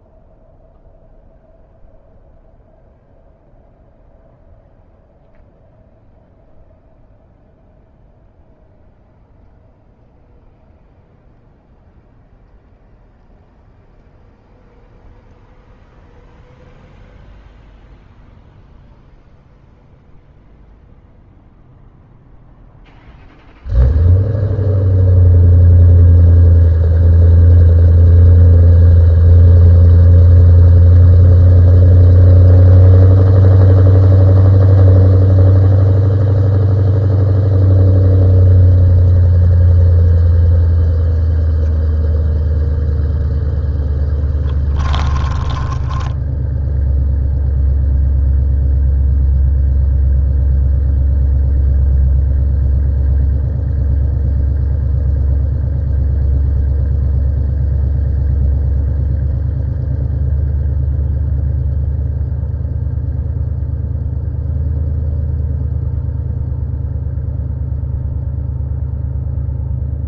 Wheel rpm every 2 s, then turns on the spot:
0, 0, 0, 0, 0, 0, 0, 0, 0, 0, 0, 0, 0, 0, 0, 0, 0, 0, 0, 0, 0, 0, 0, 10, 0, 0, 0, 0, 0, 0, 0, 0, 0, 0, 0.
46-48